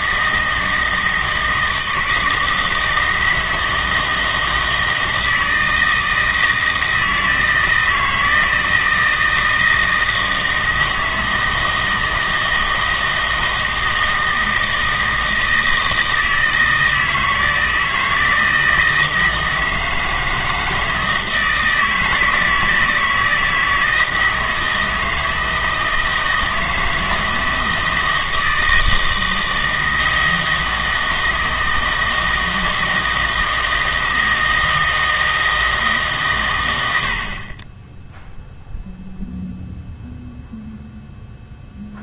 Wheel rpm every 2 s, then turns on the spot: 160, 160, 160, 160, 160, 160, 160, 160, 160, 160, 160, 160, 160, 160, 160, 160, 160, 160, 90, 0, 0.
none